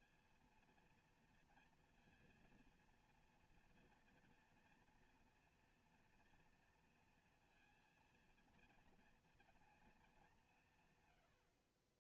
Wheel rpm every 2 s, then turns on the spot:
230, 230, 230, 230, 230, 110.
none